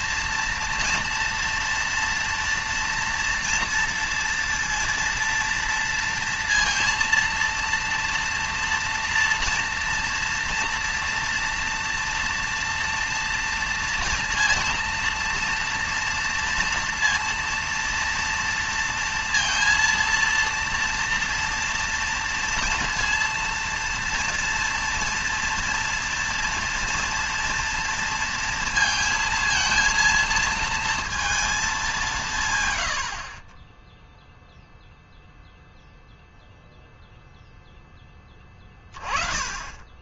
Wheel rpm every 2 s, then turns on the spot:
230, 230, 230, 230, 230, 230, 230, 230, 230, 230, 230, 230, 230, 230, 230, 230, 110, 0, 0, 20.
none